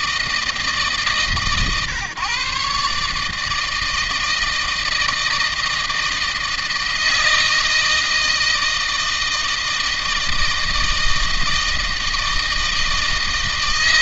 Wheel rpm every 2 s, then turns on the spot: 160, 130, 160, 160, 160, 160, 160.
none